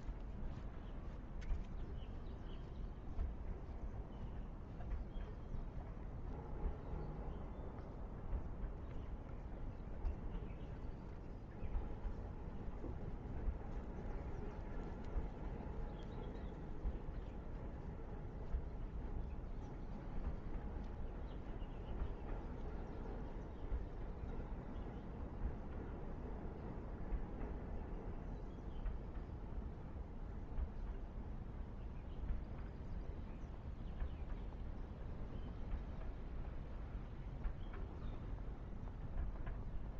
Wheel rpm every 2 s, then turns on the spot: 0, 0, 0, 0, 0, 0, 0, 0, 0, 0, 0, 0, 0, 0, 0, 0, 0, 0, 0, 0.
none